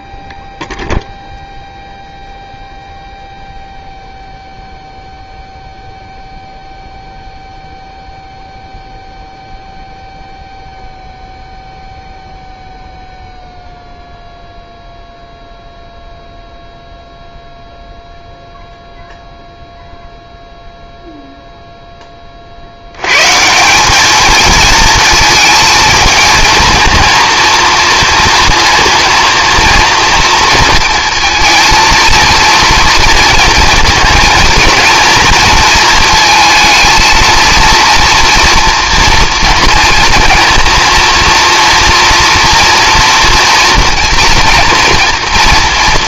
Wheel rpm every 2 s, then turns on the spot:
0, 0, 0, 0, 0, 0, 0, 0, 0, 0, 0, 60, 220, 230, 230, 230, 230, 230, 220, 240, 240, 240, 230.
none